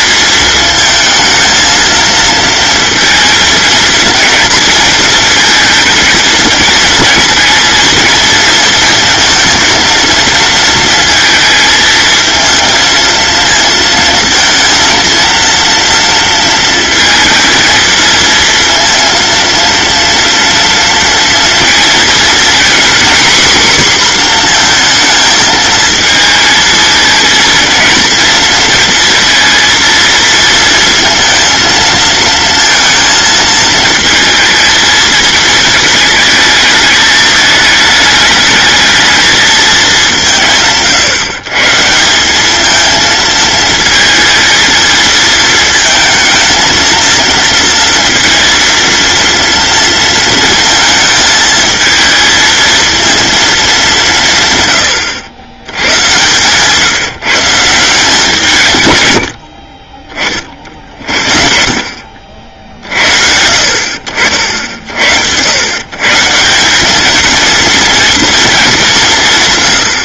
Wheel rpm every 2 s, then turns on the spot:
220, 230, 230, 230, 230, 220, 230, 230, 230, 230, 230, 250, 230, 220, 230, 230, 230, 220, 220, 220, 140, 220, 230, 230, 230, 220, 230, 120, 150, 130, 50, 60, 70, 190, 190.
none